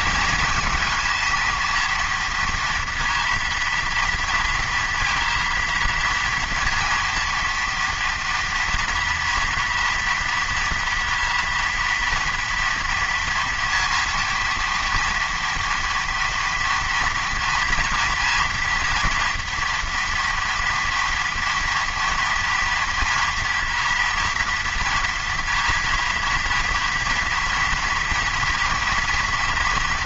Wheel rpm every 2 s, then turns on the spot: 230, 230, 230, 230, 230, 230, 230, 230, 230, 230, 230, 230, 230, 230, 240.
none